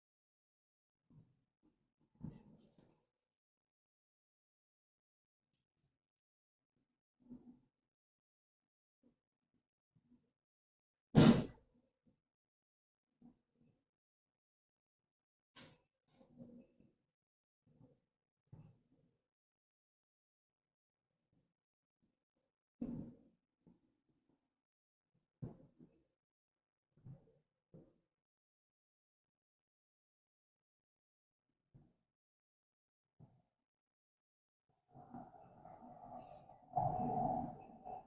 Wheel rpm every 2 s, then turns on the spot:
0, 0, 0, 0, 0, 0, 0, 0, 0, 0, 0, 0, 0, 0, 0, 0, 0, 0, 0.
none